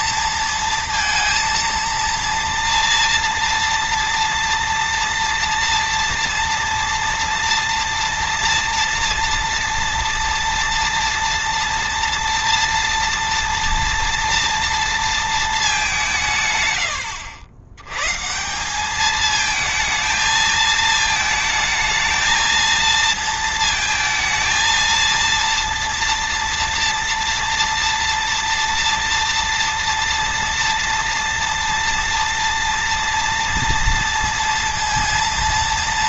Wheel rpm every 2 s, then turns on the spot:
230, 230, 230, 230, 230, 230, 230, 230, 140, 160, 220, 220, 230, 230, 230, 230, 230, 230.
none